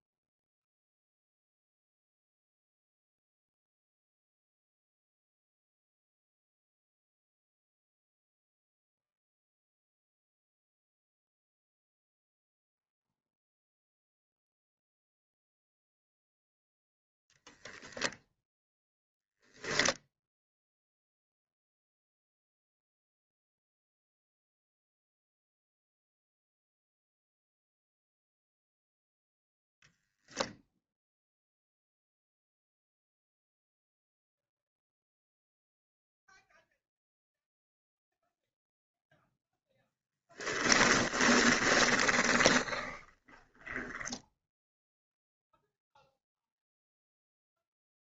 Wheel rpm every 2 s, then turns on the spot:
0, 0, 0, 0, 0, 0, 0, 0, 0, 0, 0, 0, 0, 0, 0, 0, 0, 0, 0, 0, 10, 20, 0, 0.
40-44